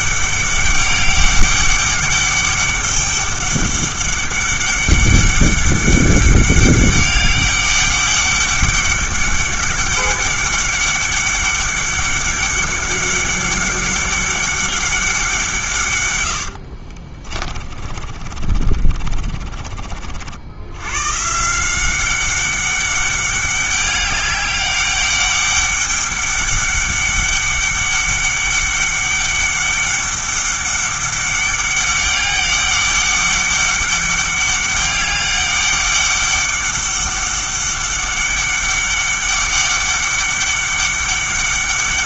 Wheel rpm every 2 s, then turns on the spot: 200, 200, 200, 200, 200, 200, 200, 200, 50, 40, 110, 200, 200, 200, 200, 200, 200, 200, 200, 200, 200.
16-20